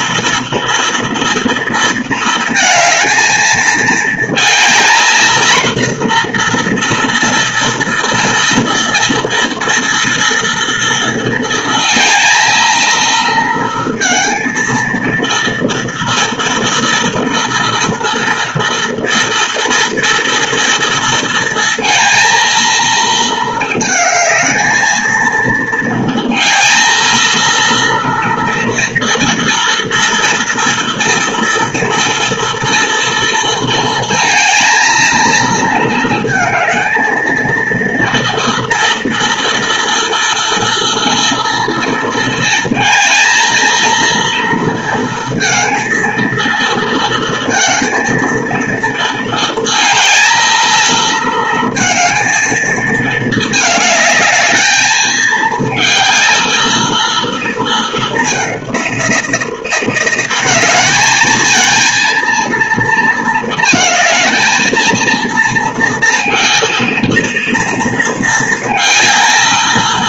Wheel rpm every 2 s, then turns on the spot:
230, 230, 230, 240, 230, 230, 220, 230, 230, 230, 230, 230, 220, 230, 230, 230, 230, 220, 220, 230, 230, 230, 230, 230, 230, 220, 230, 220, 230, 200, 190, 230, 220, 230, 220.
none